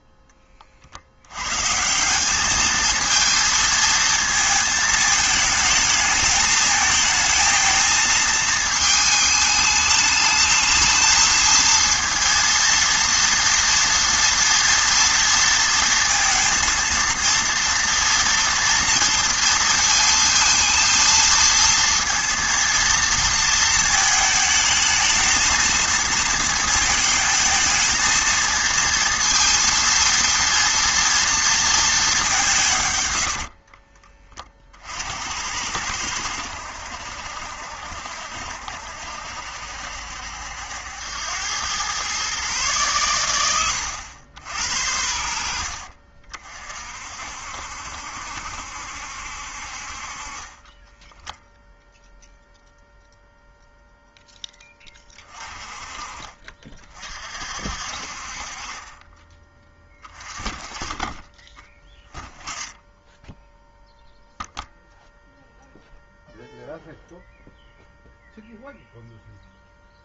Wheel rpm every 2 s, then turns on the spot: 30, 220, 220, 220, 220, 220, 230, 230, 230, 230, 230, 230, 220, 220, 230, 230, 170, 40, 80, 70, 80, 120, 70, 50, 70, 20, 0, 20, 40, 30, 20, 10, 0, 0, 0.
50-52